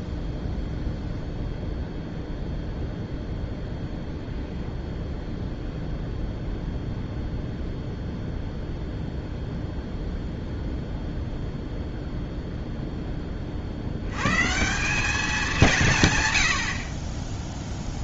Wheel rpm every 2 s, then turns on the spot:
0, 0, 0, 0, 0, 0, 0, 160, 70.
none